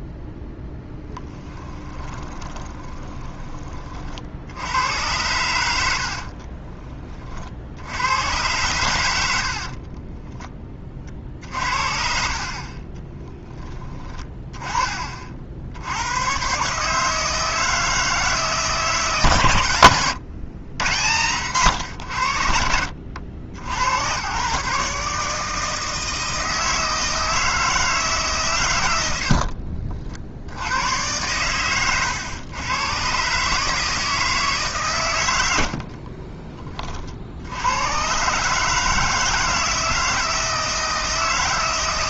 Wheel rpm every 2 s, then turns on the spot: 0, 20, 90, 30, 110, 30, 30, 20, 140, 160, 100, 70, 140, 160, 110, 90, 110, 140, 30, 150, 160.
2-4 6-8